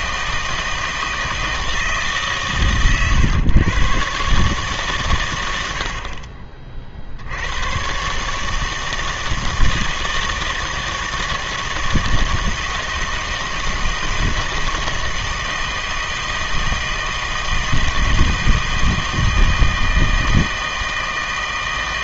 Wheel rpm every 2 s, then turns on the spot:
160, 130, 140, 50, 160, 160, 160, 160, 160, 160, 160.
none